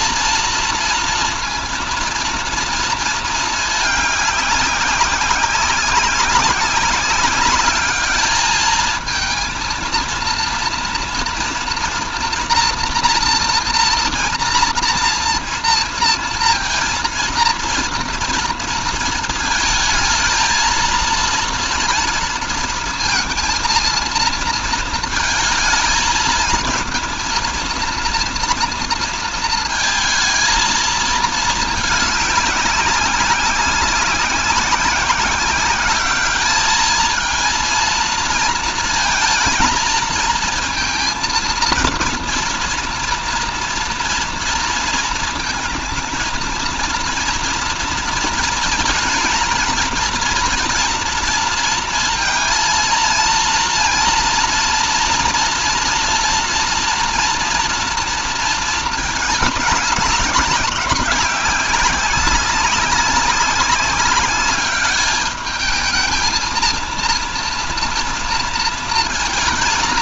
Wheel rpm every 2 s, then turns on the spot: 230, 230, 200, 200, 220, 230, 230, 230, 230, 230, 230, 230, 230, 230, 230, 220, 200, 190, 220, 230, 230, 230, 230, 230, 230, 230, 230, 230, 230, 220, 190, 200, 200, 230, 230.
none